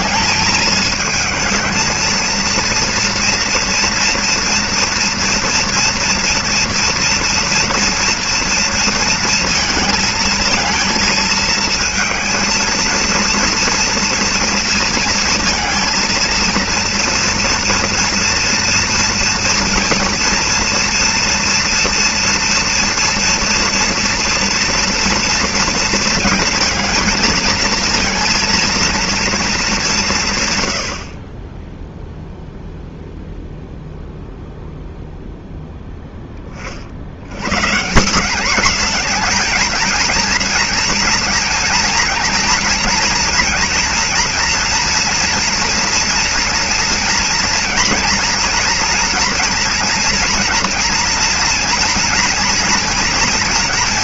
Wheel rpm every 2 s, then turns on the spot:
210, 230, 230, 230, 230, 220, 220, 230, 230, 230, 230, 230, 230, 220, 230, 120, 0, 0, 30, 210, 230, 240, 240, 230, 230, 230, 230.
none